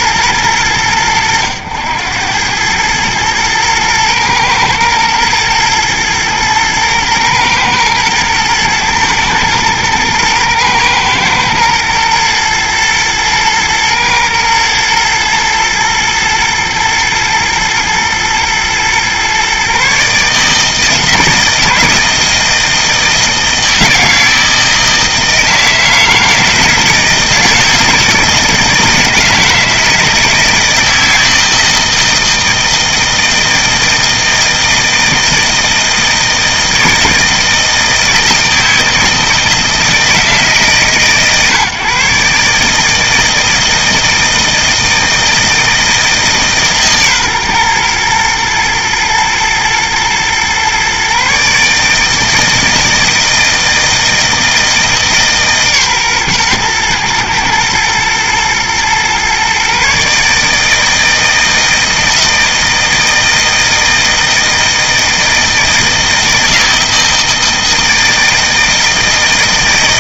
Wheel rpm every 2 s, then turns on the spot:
100, 110, 110, 110, 110, 110, 120, 110, 120, 120, 160, 160, 160, 160, 160, 160, 160, 160, 160, 160, 150, 150, 160, 140, 120, 130, 160, 160, 120, 120, 160, 160, 160, 160, 160.
none